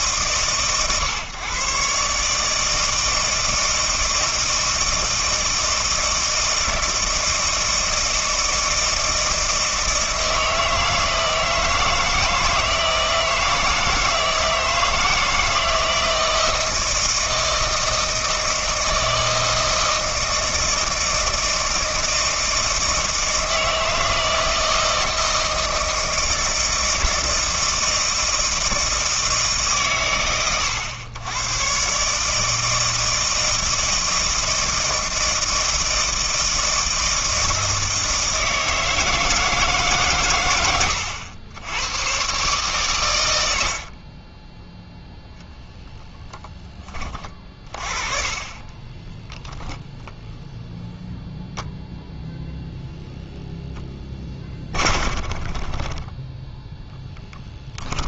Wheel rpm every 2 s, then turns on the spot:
130, 160, 160, 160, 160, 160, 160, 160, 160, 160, 160, 160, 160, 160, 160, 110, 160, 160, 160, 160, 100, 130, 0, 20, 20, 0, 0, 30, 0.
40-42 48-50 54-56